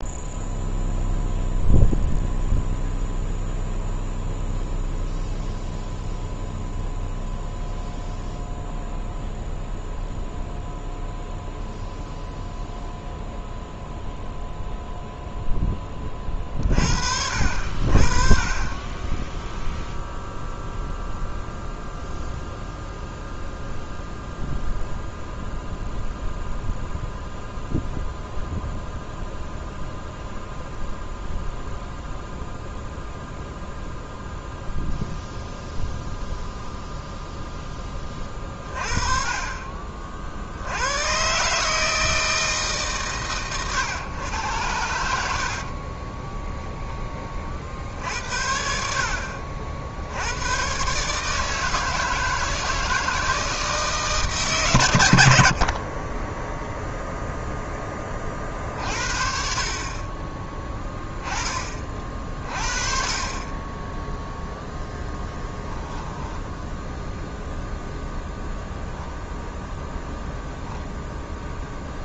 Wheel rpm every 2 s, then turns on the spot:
0, 0, 0, 0, 0, 0, 0, 0, 40, 20, 0, 0, 0, 0, 0, 0, 0, 0, 0, 30, 70, 150, 100, 0, 70, 110, 160, 140, 10, 50, 20, 40, 0, 10, 0, 0.
56-58